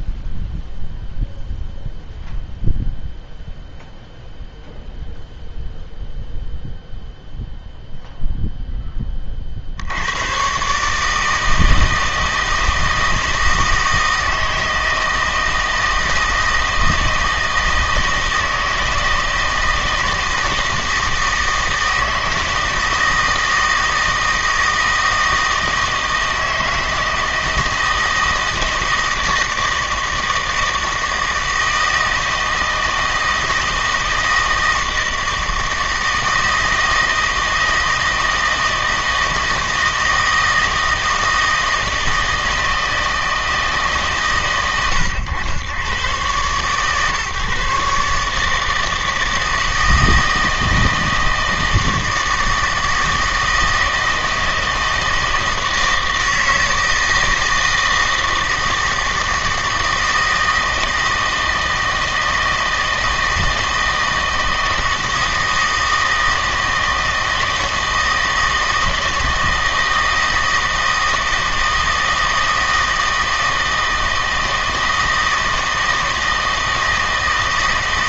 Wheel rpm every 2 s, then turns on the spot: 0, 0, 0, 0, 10, 140, 160, 160, 160, 160, 160, 160, 160, 160, 160, 160, 160, 160, 160, 160, 160, 160, 120, 130, 160, 160, 160, 160, 160, 160, 160, 160, 160, 160, 160, 160, 160, 160, 160.
none